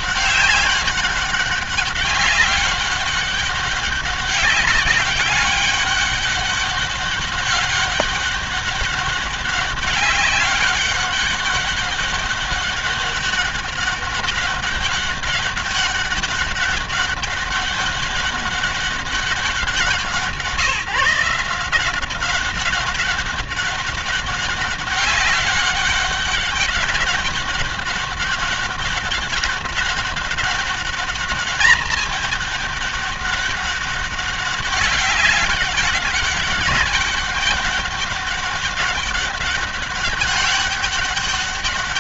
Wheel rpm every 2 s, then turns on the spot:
200, 200, 200, 200, 200, 200, 200, 200, 200, 200, 160, 200, 200, 200, 200, 200, 200, 200, 200, 200, 200.
none